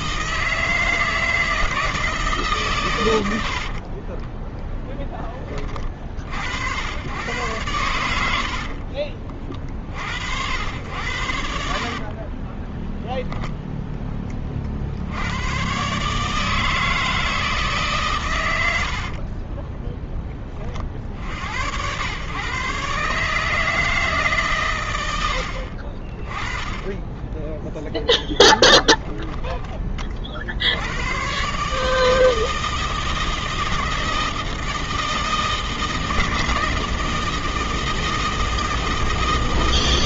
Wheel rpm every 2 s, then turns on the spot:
160, 100, 20, 110, 40, 80, 0, 80, 160, 50, 50, 140, 90, 10, 10, 110, 160, 160, 160, 160.
8-10 18-20